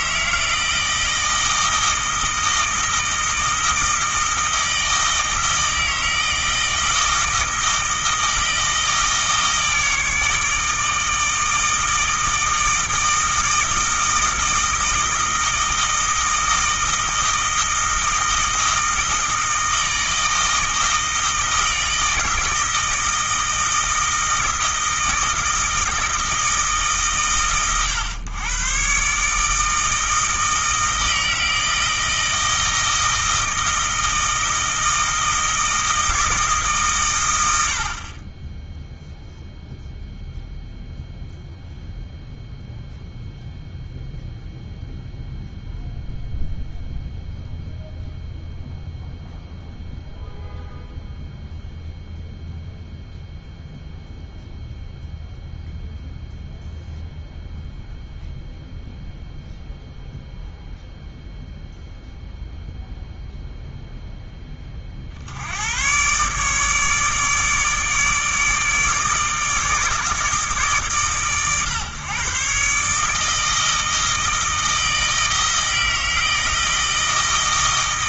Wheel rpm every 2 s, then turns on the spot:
160, 160, 160, 160, 160, 160, 160, 160, 160, 160, 160, 160, 160, 150, 130, 160, 160, 160, 140, 0, 0, 0, 0, 0, 0, 0, 0, 0, 0, 0, 0, 0, 40, 150, 160, 140, 140, 160, 160.
none